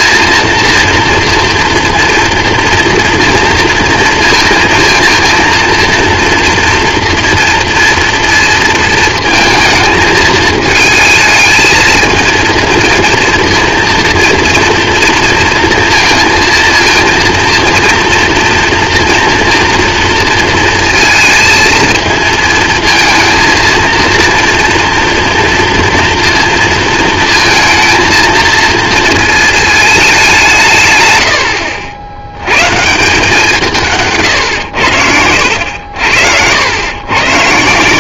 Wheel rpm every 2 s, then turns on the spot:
230, 230, 230, 230, 230, 220, 220, 230, 230, 230, 230, 220, 230, 230, 230, 140, 130, 100, 100.
none